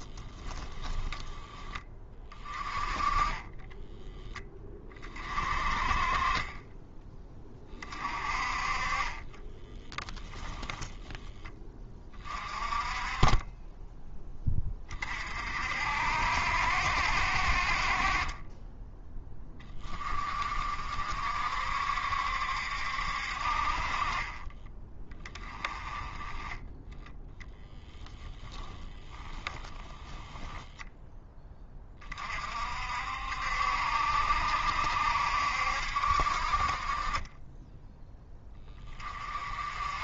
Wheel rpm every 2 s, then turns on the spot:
10, 20, 30, 20, 30, 10, 30, 30, 60, 10, 50, 60, 20, 10, 10, 10, 60, 70, 30, 20.
28-30